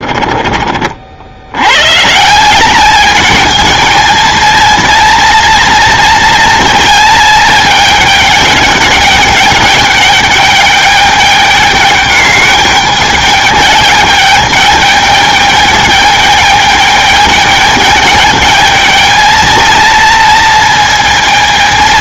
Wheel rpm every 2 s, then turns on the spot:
50, 210, 230, 220, 210, 210, 210, 210, 210, 220, 230.
none